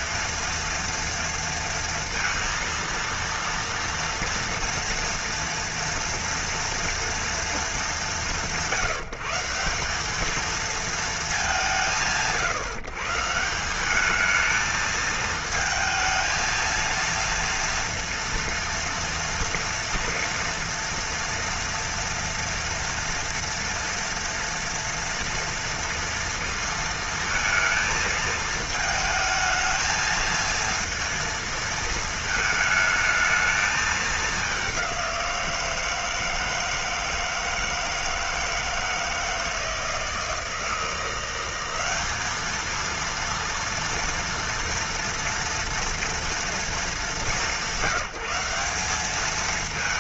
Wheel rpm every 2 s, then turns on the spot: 230, 230, 230, 230, 160, 230, 140, 220, 230, 230, 230, 230, 230, 230, 220, 230, 220, 190, 160, 160, 160, 220, 230, 220, 190.
none